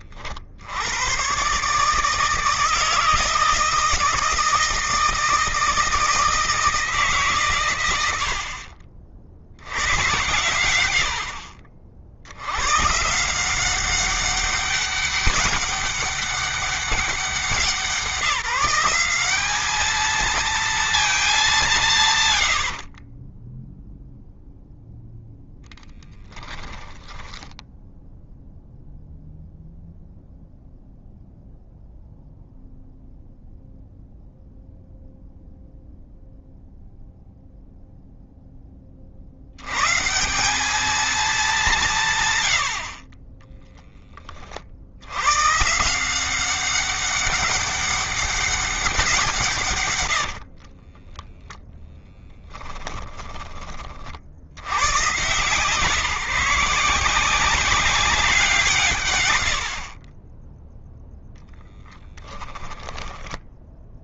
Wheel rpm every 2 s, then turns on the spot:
120, 160, 160, 140, 70, 50, 170, 200, 180, 190, 190, 10, 0, 10, 0, 0, 0, 0, 0, 40, 210, 20, 100, 190, 170, 0, 20, 150, 190, 130, 0, 10.
22-24 26-28 42-44